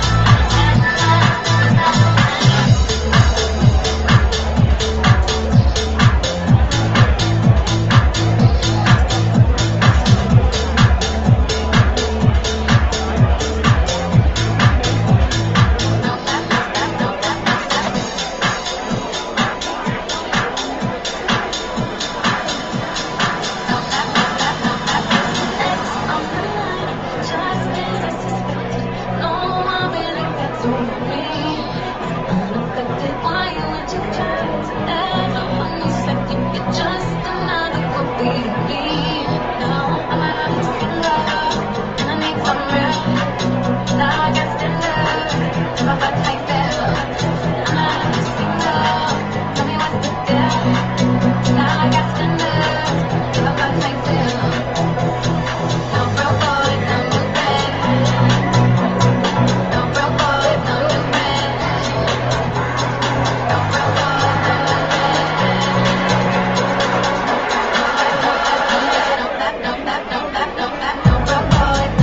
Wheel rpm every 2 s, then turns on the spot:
0, 0, 0, 0, 0, 0, 0, 0, 0, 0, 0, 0, 0, 0, 0, 0, 0, 0, 0, 0, 0, 0, 0, 0, 0, 0, 0, 0, 0, 0, 0, 0, 0, 0, 0, 0.
none